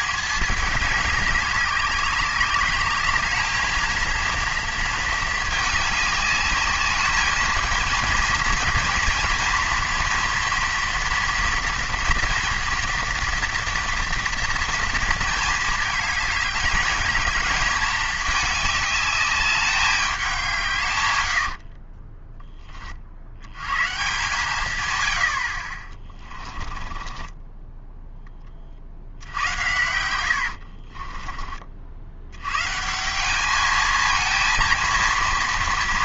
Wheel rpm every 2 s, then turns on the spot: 210, 200, 230, 210, 240, 230, 230, 230, 210, 210, 160, 20, 130, 20, 30, 60, 120, 230.
30-32